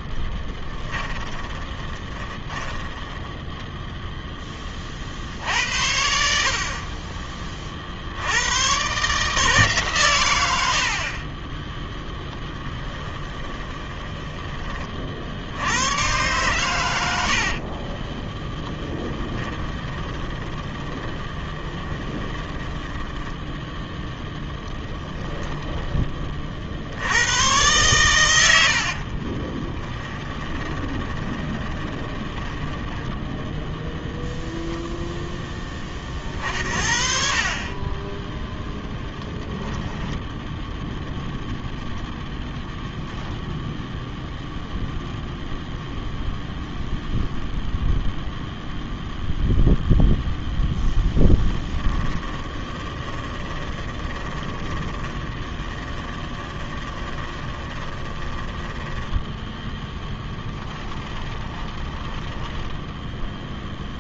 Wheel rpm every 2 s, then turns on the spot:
20, 10, 40, 40, 120, 60, 10, 30, 100, 10, 20, 10, 10, 70, 60, 20, 10, 0, 40, 10, 0, 0, 0, 0, 0, 0, 10, 30, 20, 10, 10, 0.
0-4 12-14 18-26 28-32 38-40 52-62